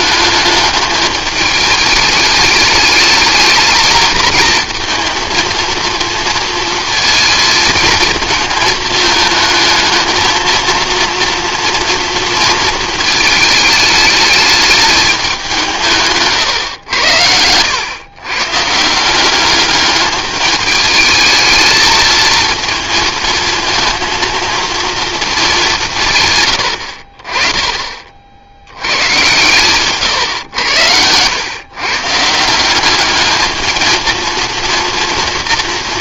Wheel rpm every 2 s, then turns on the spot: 210, 220, 220, 230, 220, 230, 230, 210, 130, 150, 210, 230, 230, 90, 90, 100, 170, 230.
none